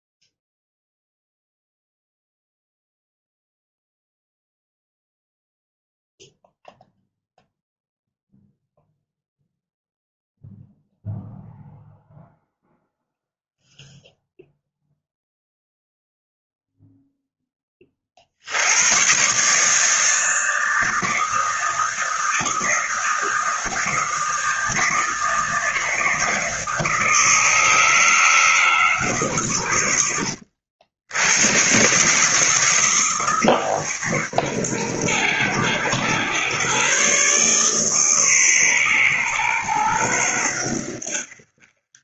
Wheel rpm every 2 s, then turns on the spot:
0, 0, 0, 0, 0, 0, 0, 0, 0, 100, 160, 160, 160, 160, 140, 80, 150, 110, 130, 120, 70.
none